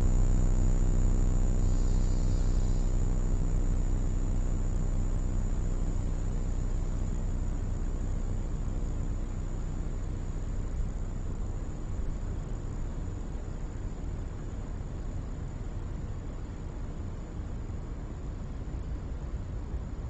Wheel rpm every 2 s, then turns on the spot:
0, 0, 0, 0, 0, 0, 0, 0, 0, 0.
none